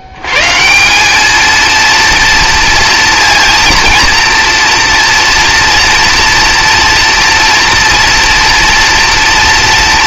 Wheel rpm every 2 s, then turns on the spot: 120, 230, 230, 230, 230.
none